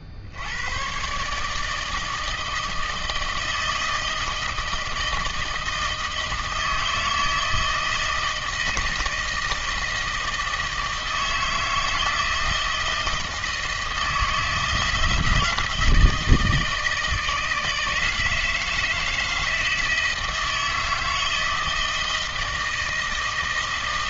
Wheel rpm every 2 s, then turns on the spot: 70, 160, 160, 160, 160, 160, 160, 170, 160, 160, 160, 160.
none